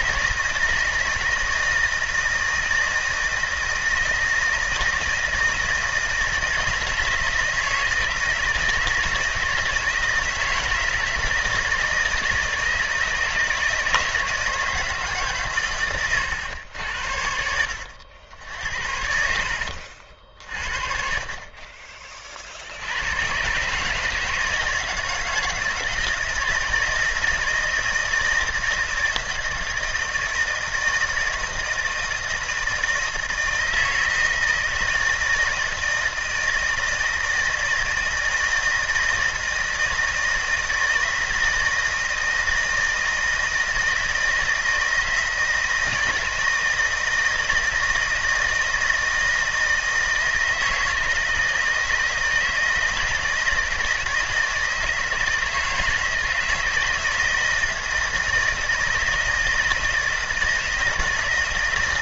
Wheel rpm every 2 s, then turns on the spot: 170, 160, 160, 160, 160, 160, 160, 150, 90, 70, 40, 80, 160, 160, 160, 160, 160, 160, 160, 160, 160, 160, 160, 160, 160, 160, 160, 160, 160, 160, 160.
18-20